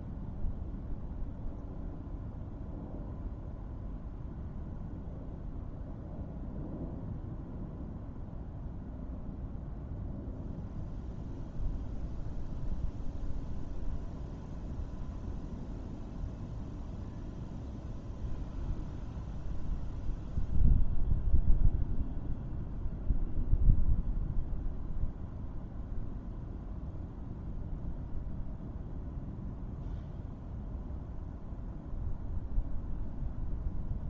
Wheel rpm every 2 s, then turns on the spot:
0, 0, 0, 0, 0, 0, 0, 0, 0, 0, 0, 0, 0, 0, 0, 0, 0.
none